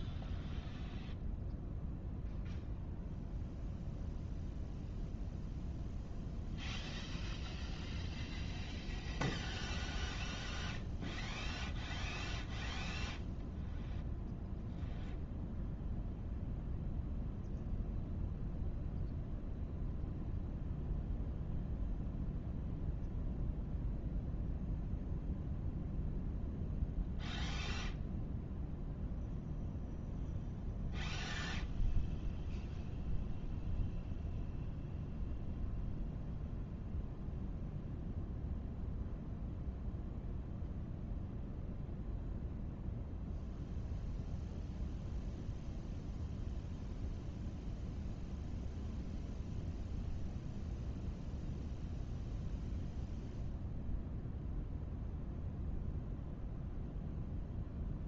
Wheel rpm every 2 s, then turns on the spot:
0, 0, 0, 0, 0, 0, 0, 0, 0, 0, 0, 0, 0, 0, 0, 0, 0, 0, 0, 0, 0, 0, 0, 0, 0, 0, 0, 0, 0.
none